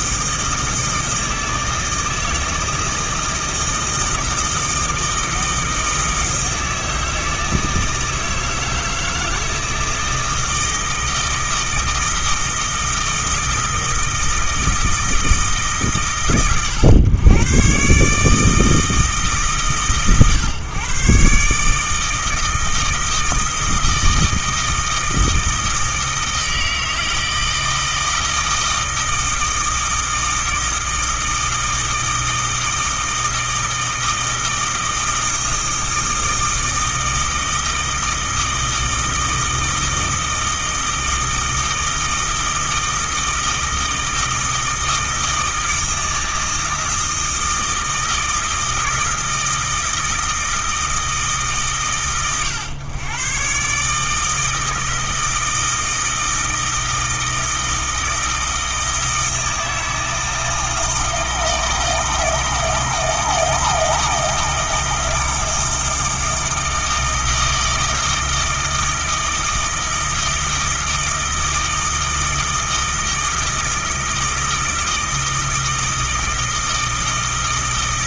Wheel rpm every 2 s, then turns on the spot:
160, 160, 160, 160, 160, 160, 160, 160, 120, 160, 130, 160, 160, 160, 160, 160, 160, 160, 160, 160, 160, 160, 160, 160, 160, 160, 120, 160, 160, 160, 160, 160, 160, 160, 160, 160, 160, 160, 160.
none